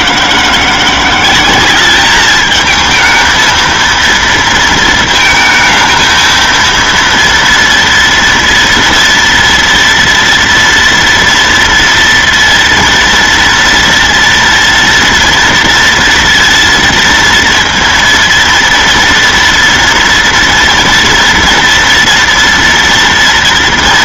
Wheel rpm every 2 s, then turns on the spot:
180, 220, 220, 230, 230, 230, 230, 230, 230, 230, 230, 230.
none